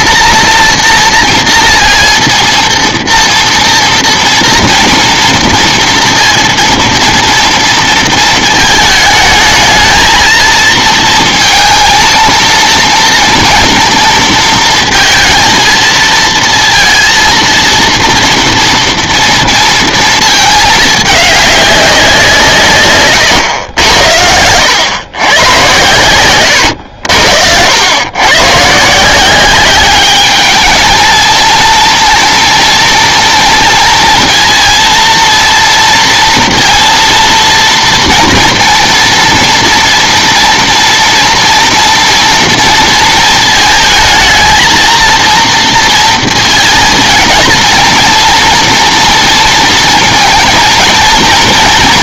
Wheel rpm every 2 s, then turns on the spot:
230, 230, 230, 230, 220, 220, 230, 230, 230, 230, 220, 150, 100, 90, 130, 220, 230, 230, 230, 240, 230, 230, 220, 230, 230, 230.
26-28